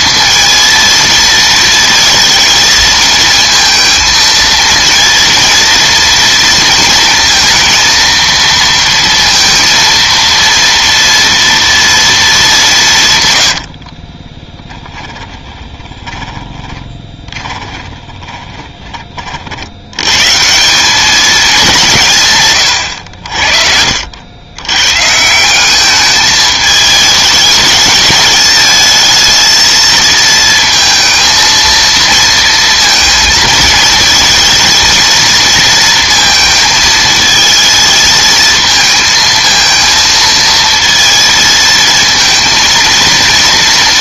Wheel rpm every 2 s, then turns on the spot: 230, 230, 230, 230, 230, 230, 190, 20, 20, 20, 170, 110, 120, 210, 220, 230, 230, 230, 220, 220, 230, 220.
14-18